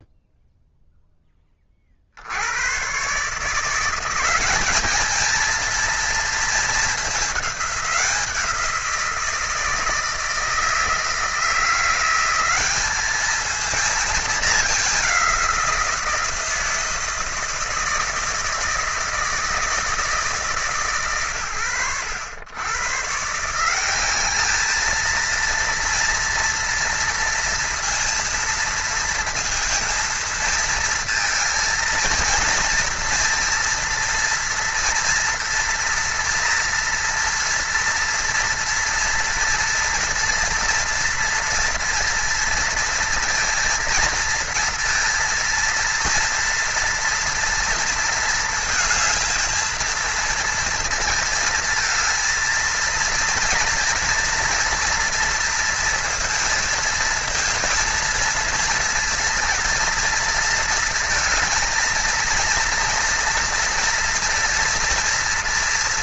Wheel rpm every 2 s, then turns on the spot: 0, 90, 190, 220, 180, 160, 190, 210, 170, 160, 160, 120, 210, 230, 230, 230, 230, 230, 230, 230, 230, 230, 230, 240, 230, 230, 230, 230, 230, 230, 230, 230, 230.
none